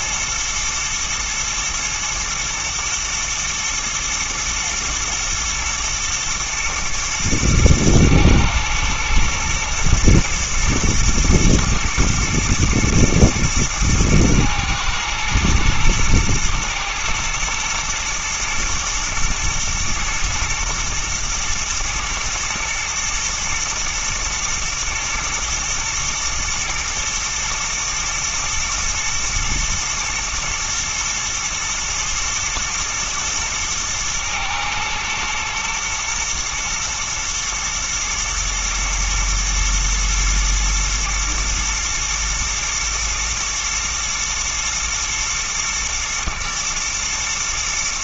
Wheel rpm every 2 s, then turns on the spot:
110, 120, 110, 110, 110, 110, 110, 110, 120, 120, 110, 110, 110, 110, 110, 120, 120, 110, 110, 110, 120, 110, 110, 120.
none